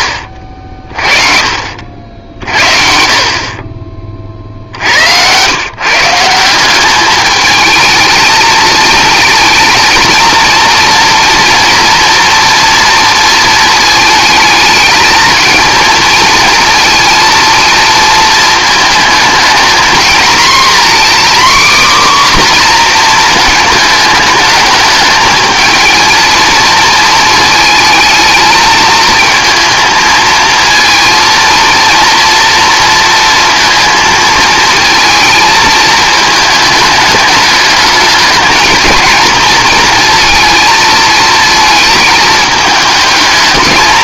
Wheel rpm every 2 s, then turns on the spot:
40, 60, 70, 190, 220, 230, 230, 220, 230, 220, 250, 250, 210, 230, 220, 230, 230, 230, 210, 230, 230, 220.
none